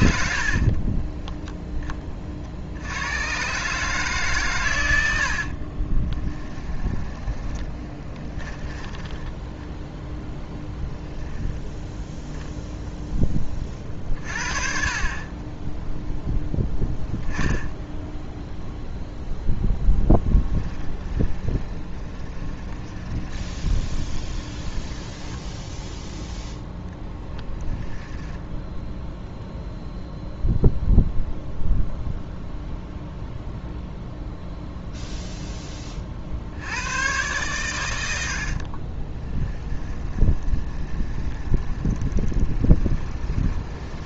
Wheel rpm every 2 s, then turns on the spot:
50, 80, 100, 20, 20, 10, 0, 40, 0, 0, 20, 20, 10, 10, 0, 0, 0, 0, 90, 40, 20, 20.
0-2 6-8 20-26 38-44